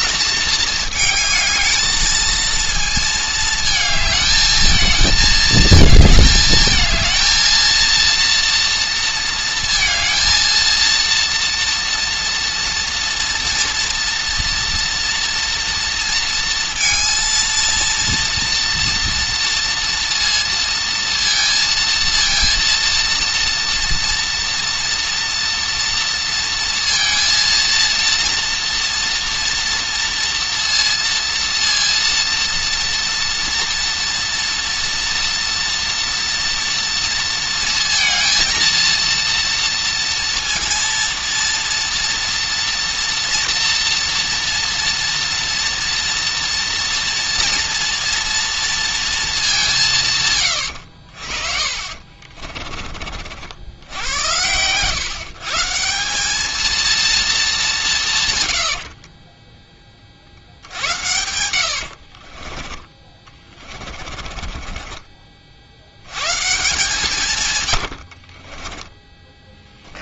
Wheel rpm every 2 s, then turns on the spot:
220, 230, 220, 220, 230, 230, 230, 230, 230, 230, 230, 230, 240, 230, 230, 230, 230, 230, 230, 230, 230, 240, 230, 230, 230, 110, 30, 110, 230, 110, 70, 30, 40, 140, 20.
52-54 62-66 68-70